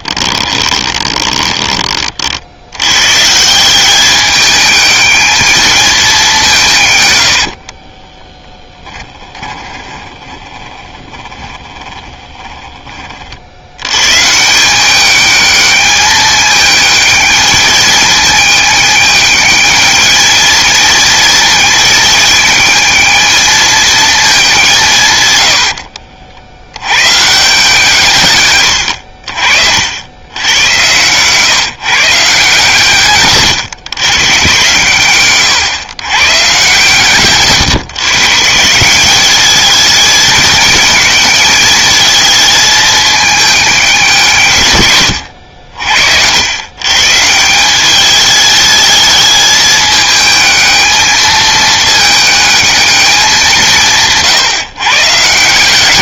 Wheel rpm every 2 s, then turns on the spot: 20, 100, 210, 130, 10, 20, 30, 190, 210, 210, 220, 220, 150, 100, 90, 120, 140, 130, 140, 170, 220, 220, 110, 130, 210, 220, 210, 140.
0-2 8-12 28-32 34-36